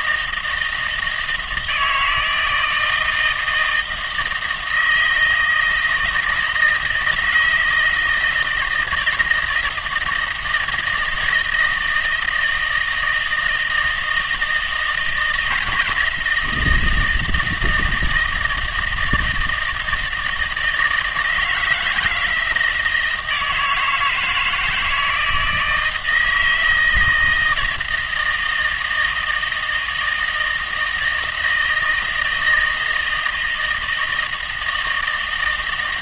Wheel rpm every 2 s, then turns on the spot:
160, 160, 160, 160, 160, 160, 160, 160, 170, 160, 160, 160, 160, 160, 160, 160, 160, 160.
none